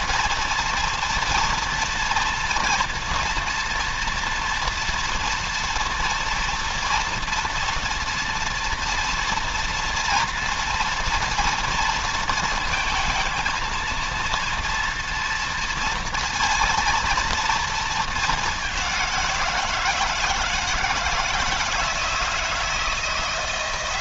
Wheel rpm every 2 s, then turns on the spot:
230, 230, 230, 230, 230, 230, 220, 230, 230, 190, 160, 170.
none